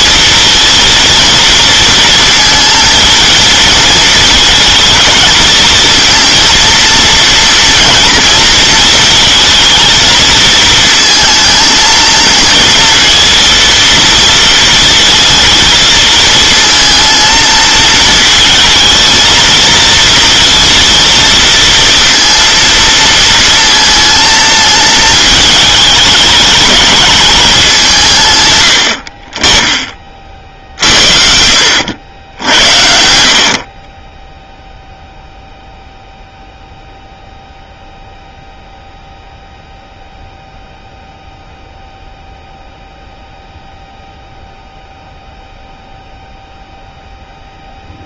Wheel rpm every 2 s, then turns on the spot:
230, 230, 220, 230, 230, 220, 230, 230, 230, 220, 230, 230, 230, 210, 80, 50, 80, 0, 0, 0, 0, 0, 0, 0.
none